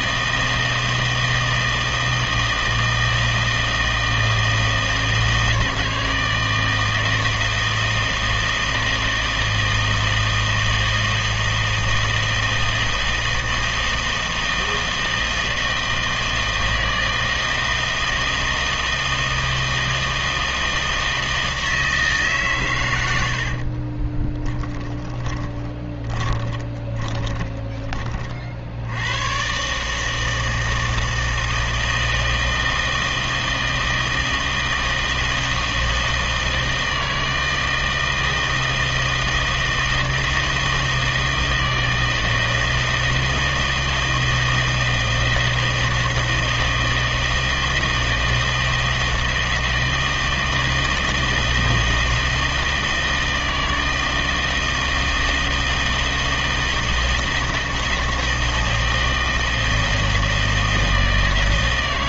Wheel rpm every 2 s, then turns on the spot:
160, 160, 160, 160, 160, 160, 160, 160, 160, 160, 160, 130, 10, 20, 60, 160, 160, 160, 160, 160, 160, 160, 160, 160, 160, 160, 160, 160, 160, 160, 160.
24-28